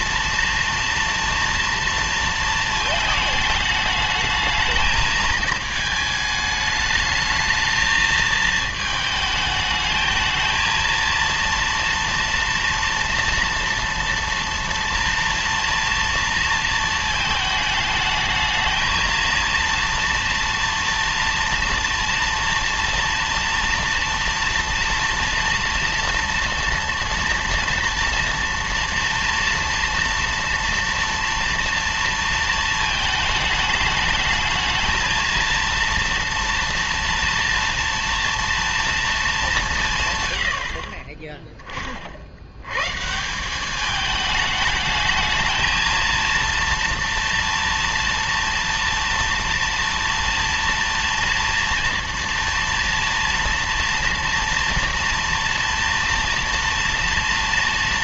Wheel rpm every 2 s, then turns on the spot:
240, 230, 220, 210, 220, 220, 230, 240, 230, 220, 240, 230, 230, 230, 240, 230, 220, 220, 230, 210, 20, 150, 220, 230, 230, 230, 230, 230, 230.
none